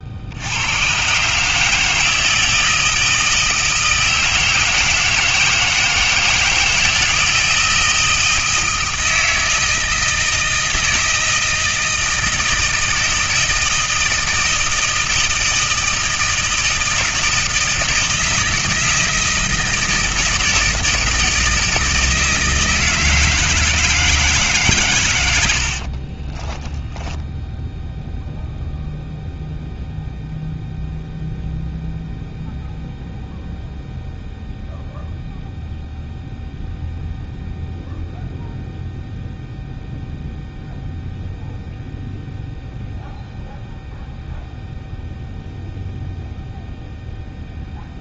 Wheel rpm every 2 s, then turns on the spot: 130, 160, 160, 160, 160, 160, 160, 160, 160, 160, 160, 160, 110, 10, 0, 0, 0, 0, 0, 0, 0, 0, 0, 0.
none